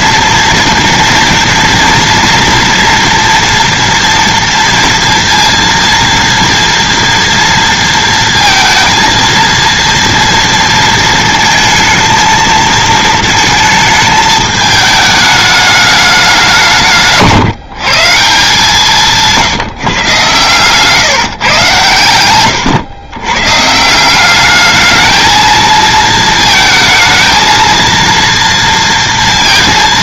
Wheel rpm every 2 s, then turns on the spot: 230, 230, 230, 230, 230, 230, 220, 210, 170, 170, 130, 120, 210, 230, 230.
none